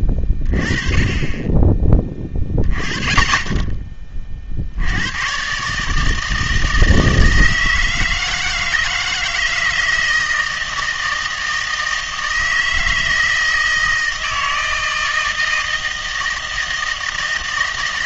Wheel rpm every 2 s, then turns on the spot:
20, 20, 70, 160, 160, 160, 160, 160, 160.
none